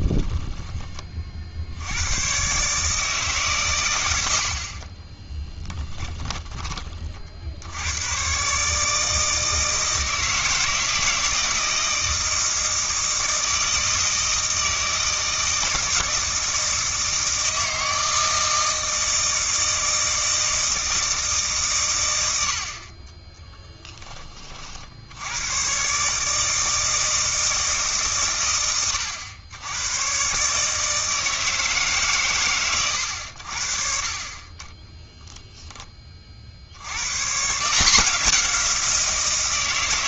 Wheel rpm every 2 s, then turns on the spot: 10, 150, 40, 30, 150, 160, 160, 160, 160, 160, 160, 50, 60, 160, 110, 150, 110, 20, 80, 180.
4-6